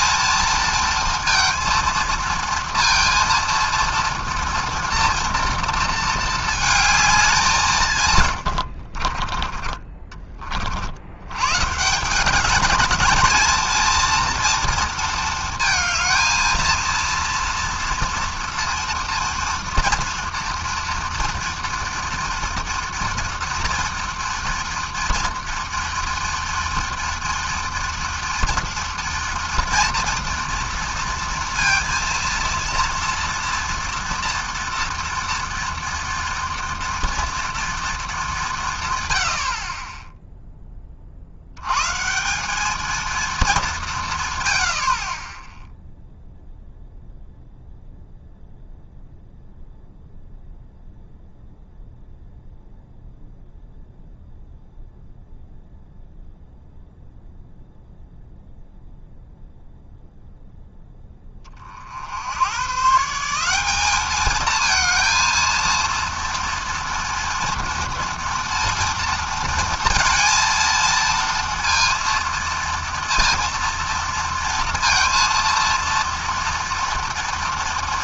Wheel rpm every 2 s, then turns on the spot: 230, 230, 230, 200, 30, 100, 220, 230, 230, 230, 230, 230, 230, 230, 230, 230, 230, 230, 230, 80, 70, 220, 30, 0, 0, 0, 0, 0, 0, 0, 20, 170, 230, 230, 230, 230, 230, 230, 230.
8-10